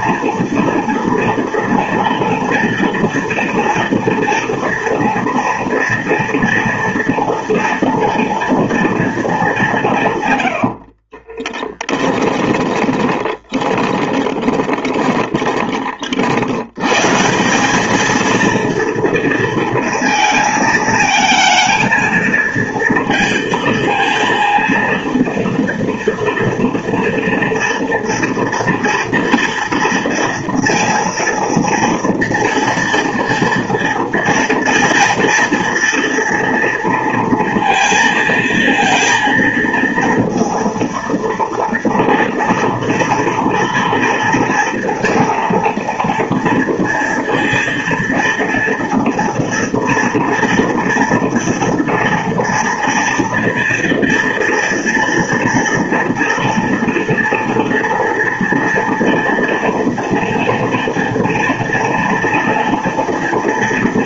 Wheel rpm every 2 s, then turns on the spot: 240, 230, 230, 230, 230, 50, 20, 20, 130, 230, 220, 230, 230, 230, 230, 230, 230, 230, 230, 230, 230, 230, 230, 230, 230, 230, 230, 230, 230, 230, 230, 230.
10-16